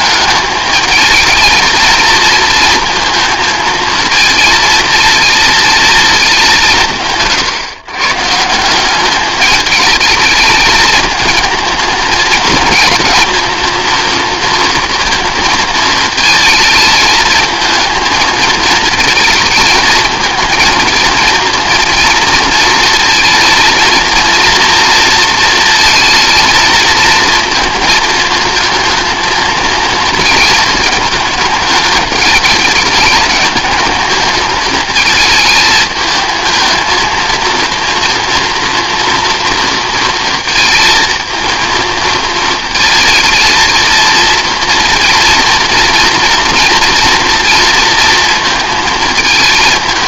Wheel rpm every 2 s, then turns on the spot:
220, 230, 220, 140, 200, 220, 230, 230, 220, 220, 230, 230, 230, 230, 220, 210, 210, 220, 220, 240, 230, 230, 230, 240, 220.
none